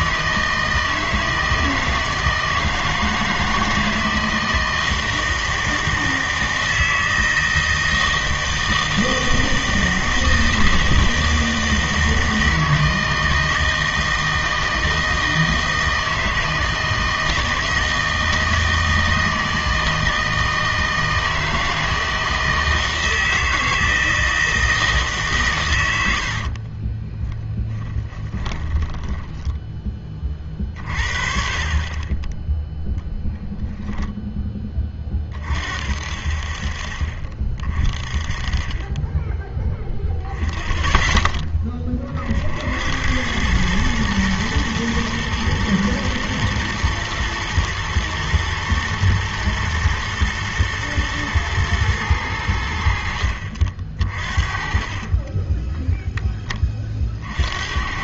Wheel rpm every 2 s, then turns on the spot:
160, 160, 160, 160, 160, 160, 160, 160, 160, 160, 160, 160, 160, 40, 20, 40, 0, 10, 50, 30, 10, 70, 110, 110, 120, 110, 80, 50, 20.
26-30 54-56